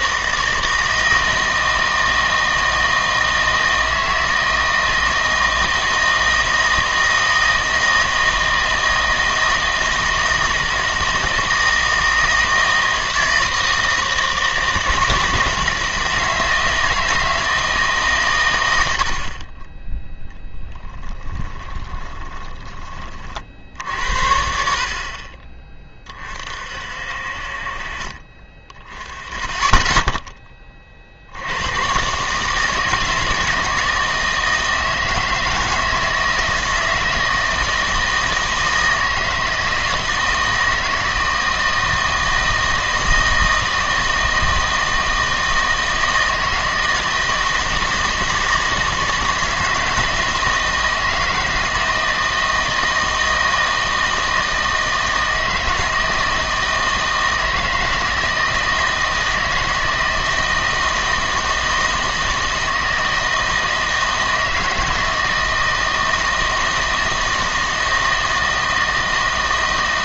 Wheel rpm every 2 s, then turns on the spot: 160, 160, 160, 160, 160, 160, 160, 160, 160, 100, 10, 20, 60, 50, 20, 30, 160, 160, 160, 160, 160, 160, 160, 160, 160, 160, 160, 160, 160, 160, 160, 160, 160, 160, 160.
20-22